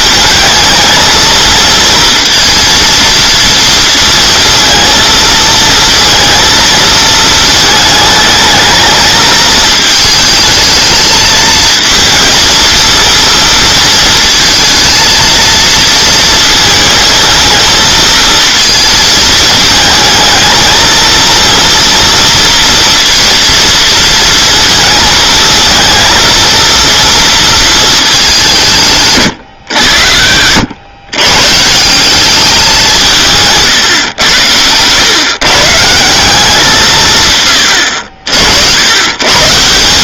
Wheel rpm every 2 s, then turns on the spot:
220, 230, 230, 230, 220, 220, 230, 230, 220, 230, 220, 230, 220, 230, 180, 90, 190, 110, 180, 80.
none